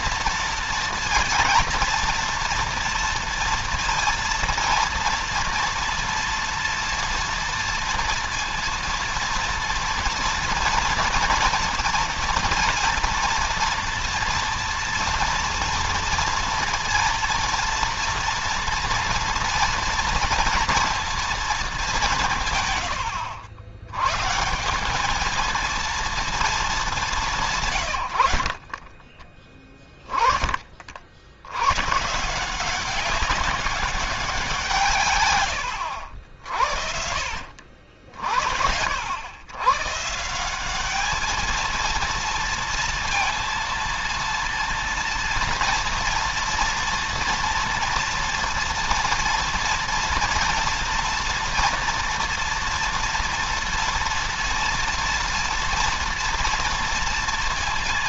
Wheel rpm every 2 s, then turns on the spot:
230, 240, 240, 230, 230, 230, 240, 230, 230, 230, 230, 90, 200, 210, 30, 60, 190, 150, 60, 80, 210, 230, 240, 230, 230, 230, 230, 230, 230.
none